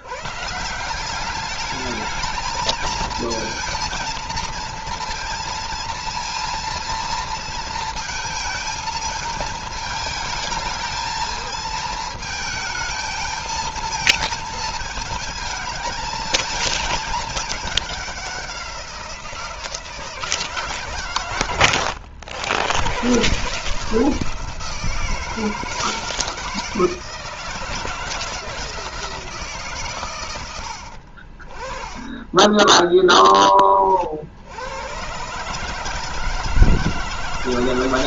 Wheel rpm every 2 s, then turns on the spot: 180, 230, 230, 230, 220, 220, 220, 220, 220, 180, 140, 120, 160, 160, 160, 70, 10, 110, 160.
none